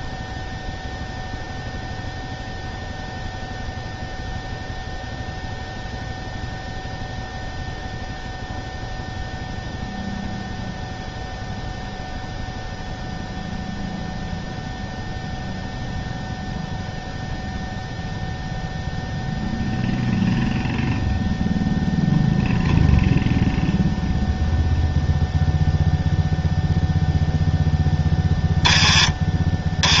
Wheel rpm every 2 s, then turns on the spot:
0, 0, 0, 0, 0, 0, 0, 0, 0, 0, 0, 0, 0, 0, 10.
none